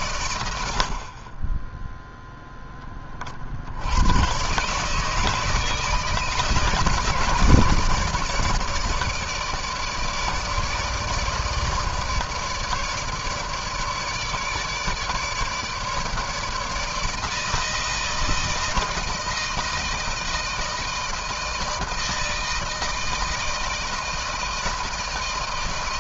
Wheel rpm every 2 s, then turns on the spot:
100, 0, 120, 160, 160, 150, 150, 150, 160, 160, 160, 160, 160.
none